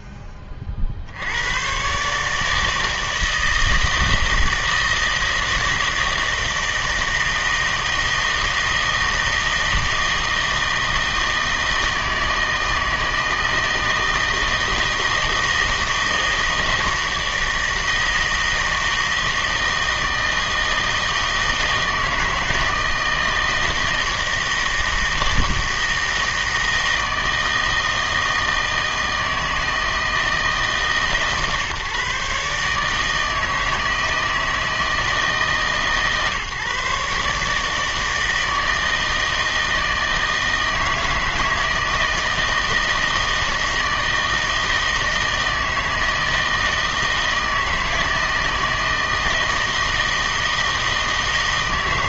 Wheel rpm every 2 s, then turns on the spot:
30, 150, 160, 160, 160, 160, 160, 160, 160, 160, 160, 160, 160, 160, 160, 150, 140, 160, 140, 160, 160, 160, 160, 160, 160, 160.
none